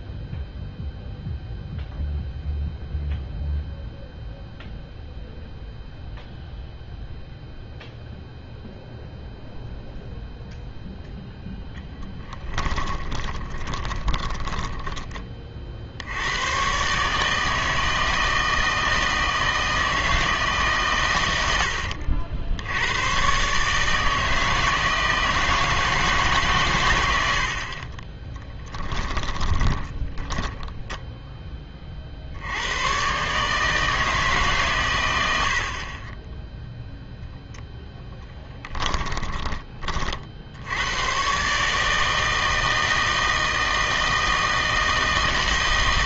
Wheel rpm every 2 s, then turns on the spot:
0, 0, 0, 0, 0, 0, 10, 20, 130, 160, 140, 90, 160, 120, 10, 10, 90, 130, 0, 10, 80, 160, 160.
12-16 28-32 38-40